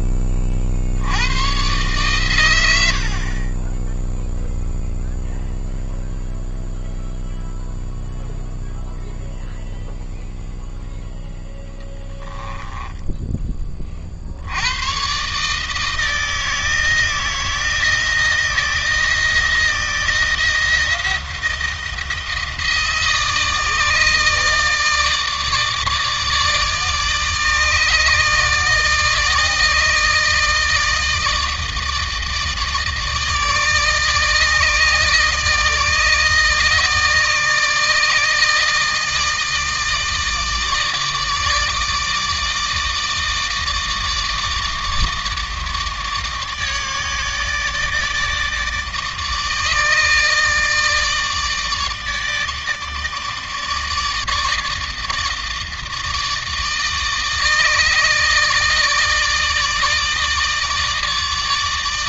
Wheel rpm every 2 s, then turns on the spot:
70, 60, 0, 0, 0, 0, 10, 100, 160, 160, 160, 160, 150, 160, 160, 160, 160, 150, 150, 160, 160, 160, 160, 150, 150, 160, 150, 150, 150, 150, 150.
12-14